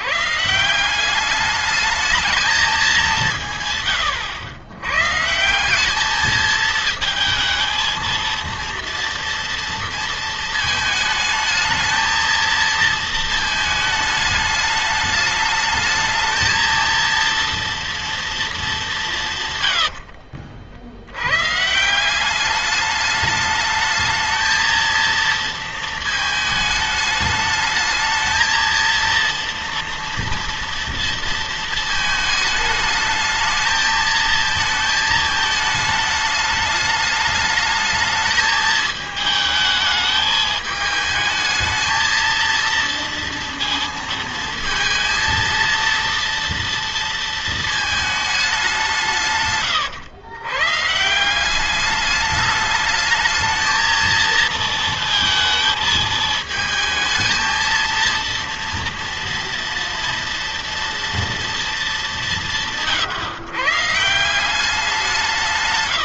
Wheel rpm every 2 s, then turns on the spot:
160, 210, 100, 220, 230, 220, 230, 210, 220, 220, 70, 200, 230, 220, 220, 230, 220, 220, 210, 220, 220, 230, 230, 230, 200, 120, 210, 230, 220, 230, 240, 180, 180.
none